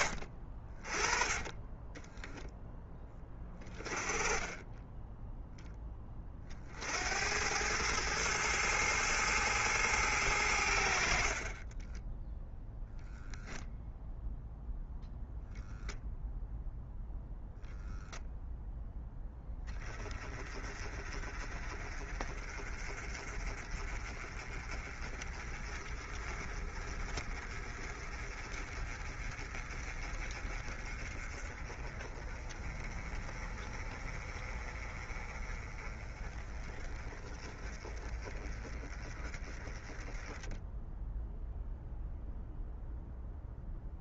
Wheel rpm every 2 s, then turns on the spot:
40, 20, 20, 70, 110, 70, 0, 0, 0, 0, 30, 30, 30, 30, 30, 30, 30, 30, 20, 20, 10, 0.
0-2